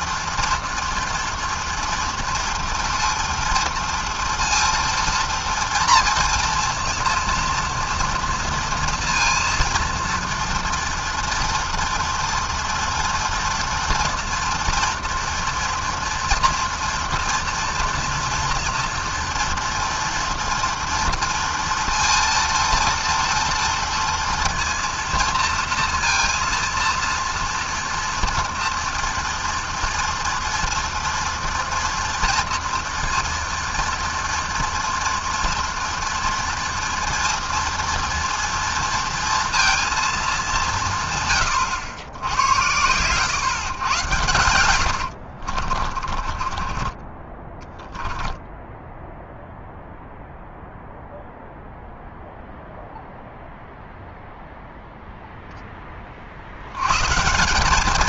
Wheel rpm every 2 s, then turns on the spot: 230, 230, 230, 230, 230, 230, 230, 230, 230, 230, 230, 230, 230, 230, 230, 230, 230, 230, 230, 230, 120, 120, 60, 10, 0, 0, 0, 0, 180.
44-46